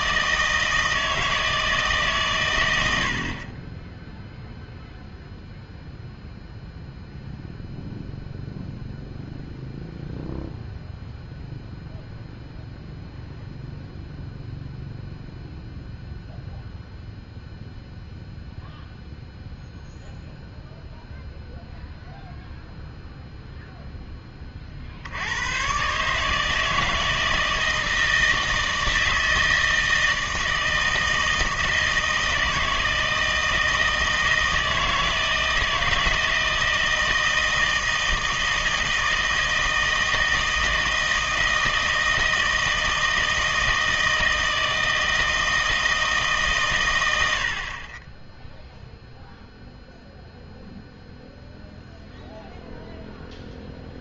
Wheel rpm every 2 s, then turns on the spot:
160, 90, 0, 0, 0, 0, 0, 0, 0, 0, 0, 0, 60, 160, 160, 160, 160, 160, 160, 160, 160, 160, 160, 120, 0, 0, 0.
none